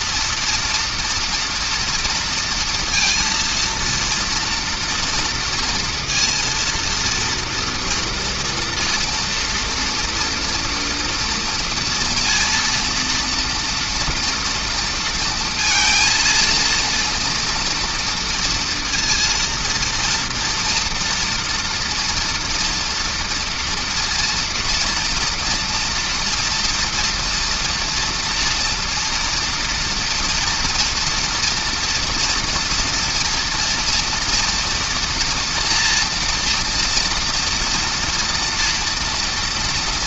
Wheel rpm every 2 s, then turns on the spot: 230, 230, 230, 230, 230, 230, 230, 230, 230, 230, 230, 240, 230, 230, 240, 230, 230, 230, 230, 230.
none